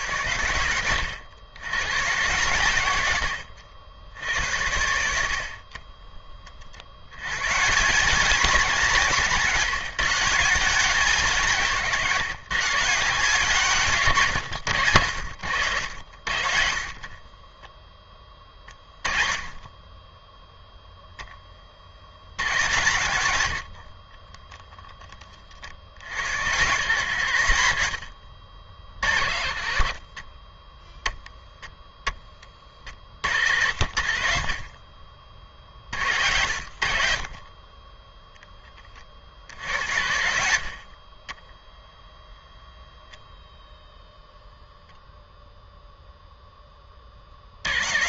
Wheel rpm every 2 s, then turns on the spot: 90, 110, 90, 40, 190, 180, 150, 110, 60, 20, 0, 100, 10, 110, 60, 10, 20, 40, 70, 10, 60, 0, 0, 10.
22-24 40-42